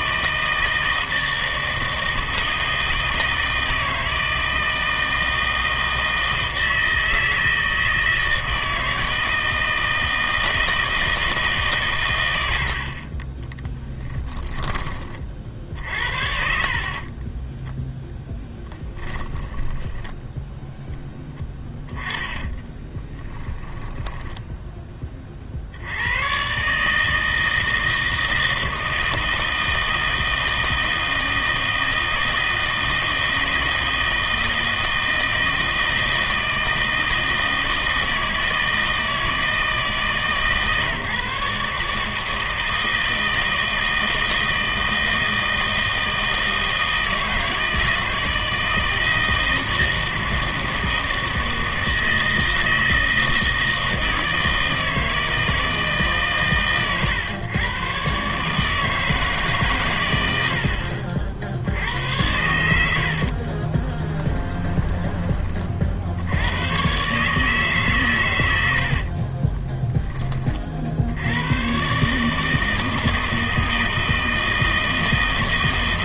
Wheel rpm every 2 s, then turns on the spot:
160, 160, 160, 160, 160, 160, 70, 20, 50, 10, 0, 10, 10, 140, 160, 160, 160, 160, 160, 160, 150, 160, 160, 160, 160, 160, 160, 160, 130, 150, 70, 80, 10, 110, 80, 50, 160, 160.
18-20 22-24 62-66 68-70